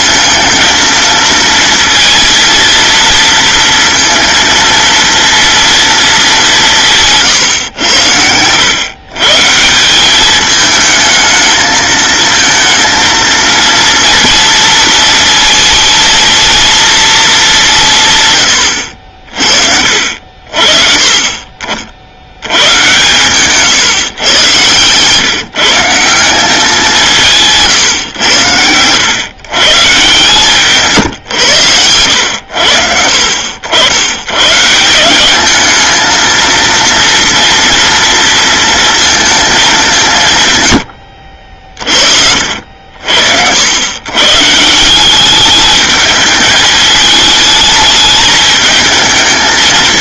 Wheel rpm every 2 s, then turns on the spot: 230, 230, 230, 180, 110, 220, 220, 230, 230, 110, 50, 110, 120, 190, 100, 140, 70, 130, 230, 230, 120, 70, 150, 210, 220.
none